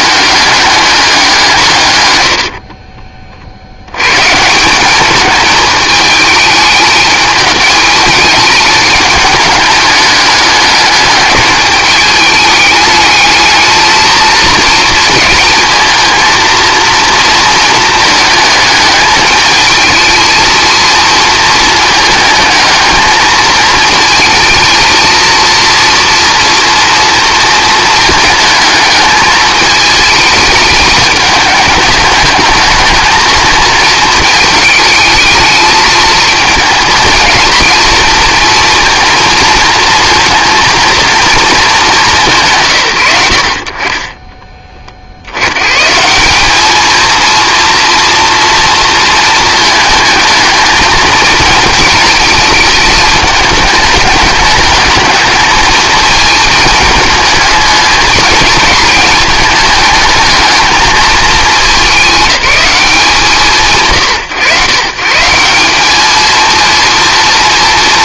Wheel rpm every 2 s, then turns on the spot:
200, 60, 170, 210, 210, 210, 220, 230, 230, 210, 230, 210, 230, 230, 220, 220, 220, 220, 220, 230, 230, 130, 30, 210, 230, 220, 220, 210, 220, 220, 220, 190, 130, 230.
2-4